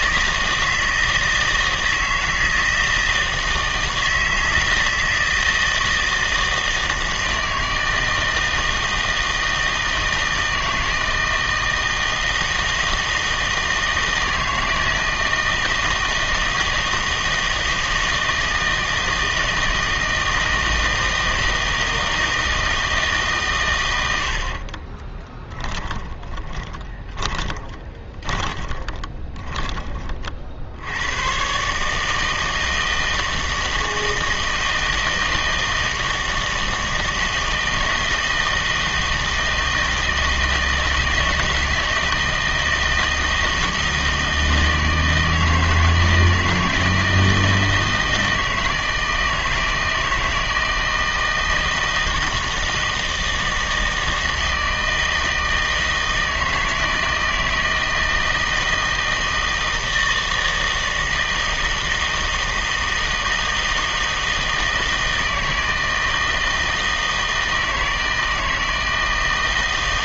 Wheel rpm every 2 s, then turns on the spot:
160, 160, 160, 160, 160, 160, 160, 160, 160, 160, 160, 160, 40, 20, 20, 70, 160, 160, 160, 160, 160, 160, 160, 160, 160, 160, 160, 160, 160, 160, 160, 160, 160, 160, 160.
24-30